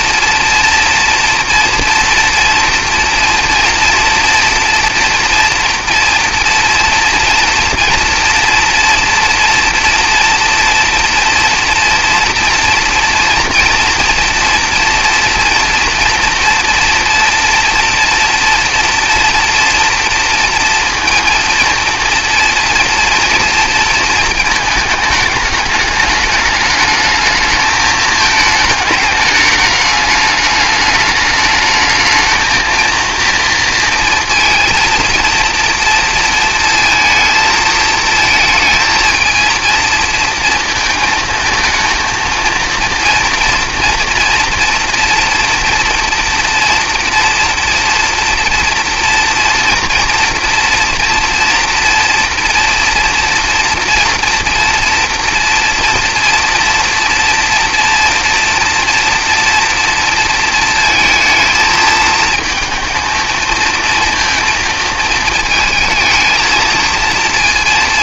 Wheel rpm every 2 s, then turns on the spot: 230, 230, 230, 230, 230, 230, 230, 230, 240, 230, 230, 230, 220, 210, 220, 210, 230, 230, 230, 220, 230, 230, 230, 230, 230, 230, 230, 230, 230, 230, 230, 230, 230, 220.
none